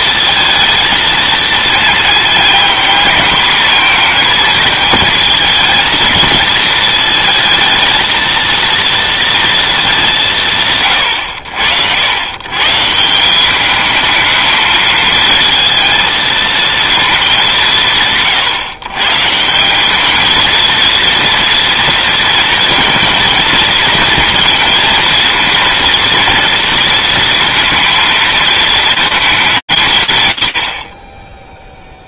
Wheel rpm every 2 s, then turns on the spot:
230, 230, 220, 220, 230, 150, 150, 220, 230, 140, 220, 230, 230, 230, 230, 70.
none